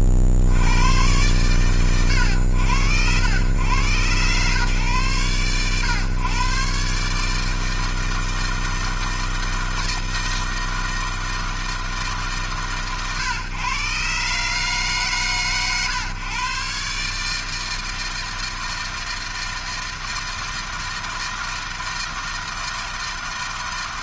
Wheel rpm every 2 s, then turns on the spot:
70, 100, 120, 130, 160, 160, 130, 140, 130, 160, 160, 160.
none